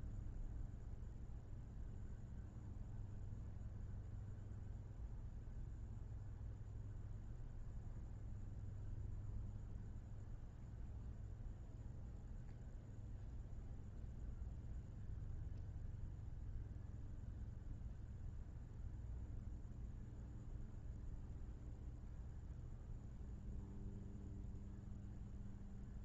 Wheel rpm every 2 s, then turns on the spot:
0, 0, 0, 0, 0, 0, 0, 0, 0, 0, 0, 0, 0.
none